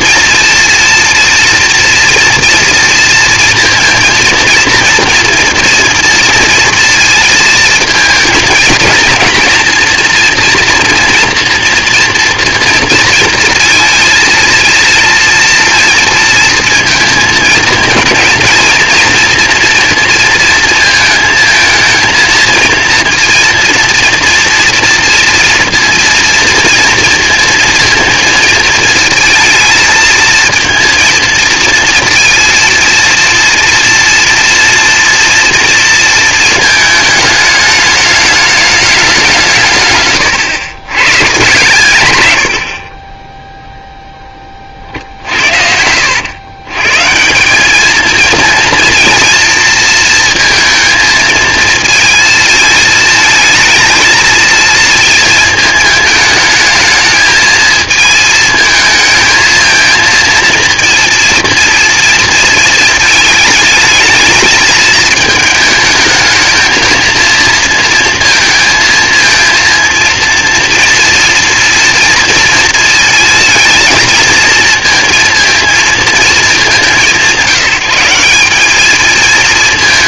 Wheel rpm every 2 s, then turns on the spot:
230, 230, 230, 230, 220, 240, 230, 230, 220, 230, 230, 230, 230, 230, 220, 230, 230, 230, 220, 210, 120, 80, 20, 110, 230, 230, 230, 230, 220, 220, 230, 230, 210, 220, 220, 230, 230, 230, 220, 190.
40-42